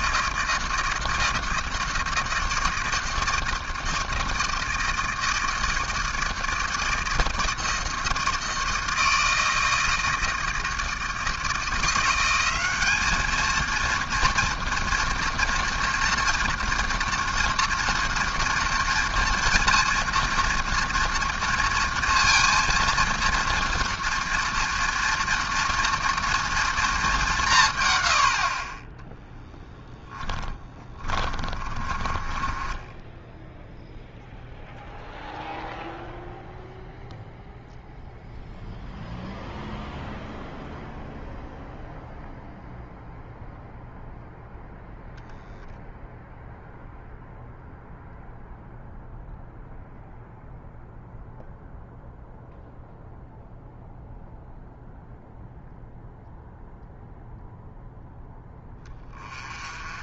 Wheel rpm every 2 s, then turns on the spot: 160, 160, 160, 160, 160, 160, 200, 230, 230, 230, 230, 230, 230, 230, 30, 20, 20, 0, 0, 0, 0, 0, 0, 0, 0, 0, 0, 0, 0, 10.
30-34